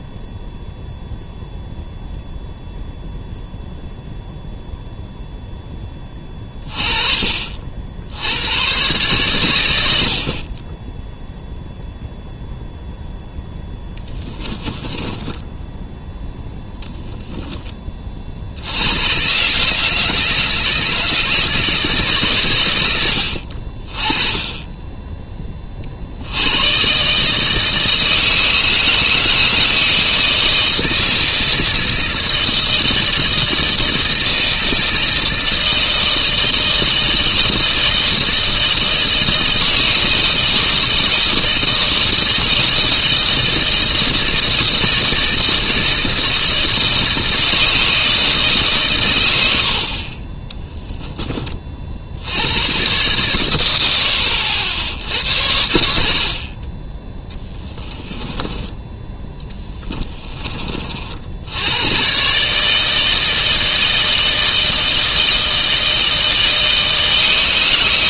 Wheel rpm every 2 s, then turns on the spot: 0, 0, 0, 30, 110, 20, 0, 10, 10, 70, 160, 110, 20, 110, 160, 160, 160, 160, 160, 160, 160, 160, 160, 160, 150, 10, 100, 80, 30, 20, 40, 150, 160, 160.
14-16